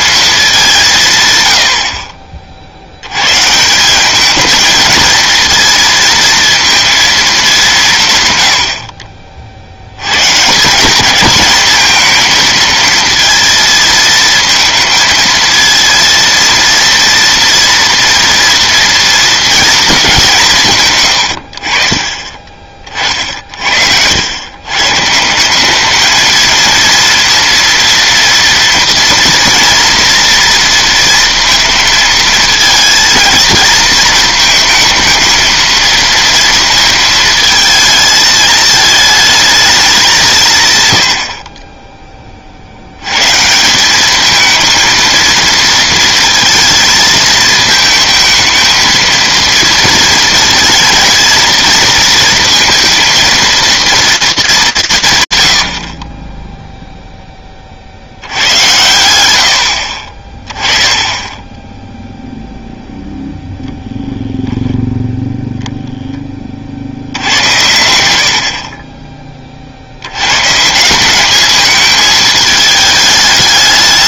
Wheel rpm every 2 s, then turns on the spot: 190, 60, 220, 230, 90, 170, 230, 230, 230, 230, 150, 40, 120, 230, 240, 230, 220, 220, 230, 220, 140, 60, 220, 230, 230, 230, 230, 150, 0, 110, 10, 0, 0, 50, 40, 160, 220.
none